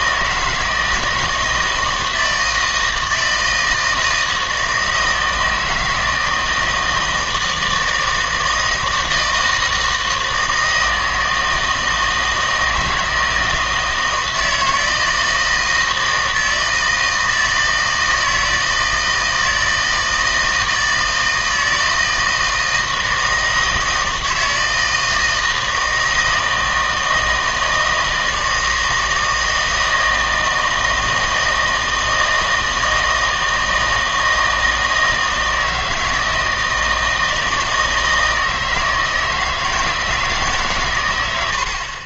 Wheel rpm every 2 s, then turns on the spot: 160, 160, 160, 160, 160, 160, 160, 160, 160, 160, 160, 160, 160, 160, 160, 160, 160, 160, 160, 160, 130.
none